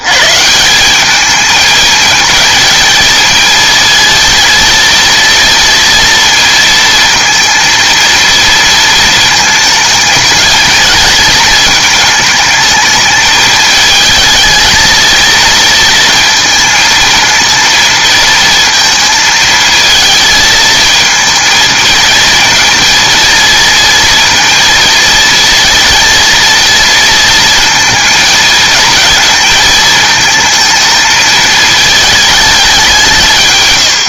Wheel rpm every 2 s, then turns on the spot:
160, 220, 230, 230, 230, 220, 220, 220, 220, 230, 230, 230, 230, 230, 220, 220, 210.
none